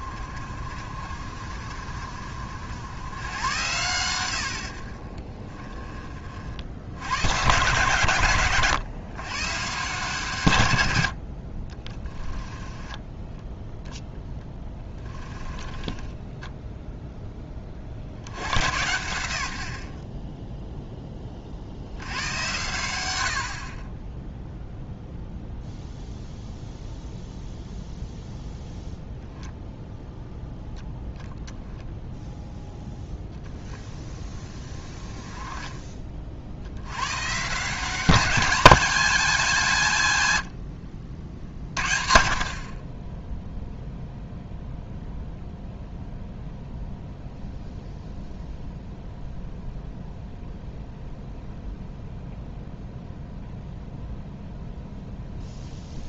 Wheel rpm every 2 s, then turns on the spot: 50, 90, 40, 90, 130, 90, 10, 10, 0, 100, 10, 100, 0, 0, 0, 0, 0, 20, 100, 200, 70, 30, 0, 0, 0, 0, 0, 0.
12-16